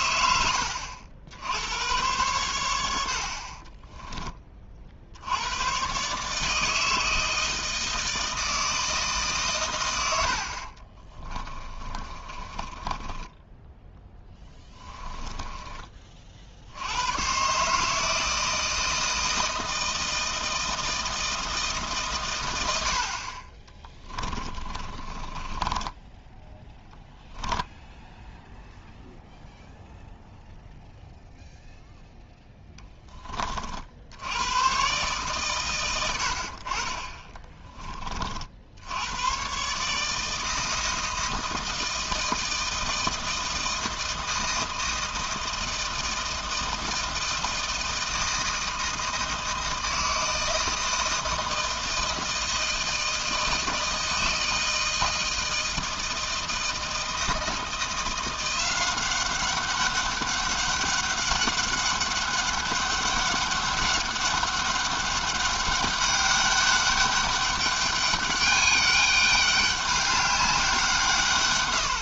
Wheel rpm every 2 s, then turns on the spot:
70, 90, 40, 160, 170, 50, 20, 10, 80, 160, 170, 90, 30, 10, 0, 0, 10, 110, 50, 60, 160, 160, 160, 160, 160, 160, 160, 160, 160, 180, 200, 200, 200, 200, 200, 190.
10-16 24-28